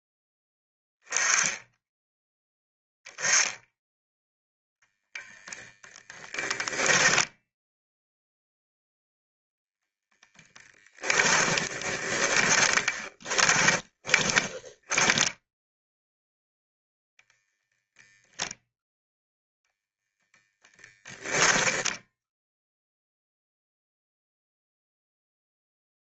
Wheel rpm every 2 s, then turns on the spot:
10, 10, 0, 10, 0, 20, 30, 10, 0, 0, 10, 0, 0.
6-8 10-16 20-22